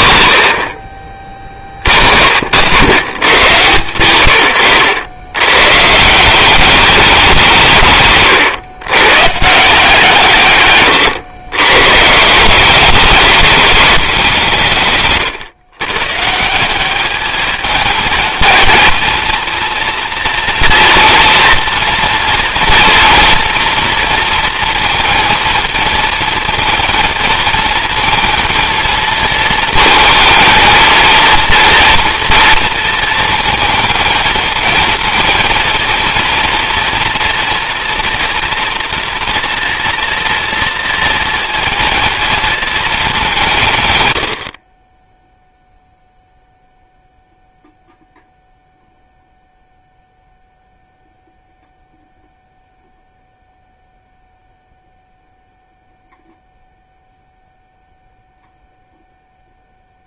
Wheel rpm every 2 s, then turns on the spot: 40, 100, 90, 200, 120, 130, 190, 160, 180, 220, 230, 230, 230, 220, 230, 230, 230, 230, 230, 230, 230, 220, 40, 0, 0, 0, 0, 0, 0, 0.
none